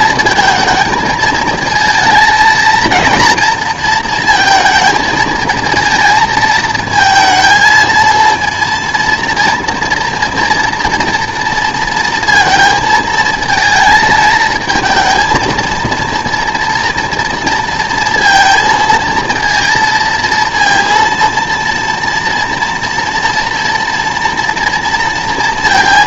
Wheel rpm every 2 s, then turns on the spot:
230, 220, 230, 220, 230, 230, 230, 220, 230, 230, 230, 230, 230.
none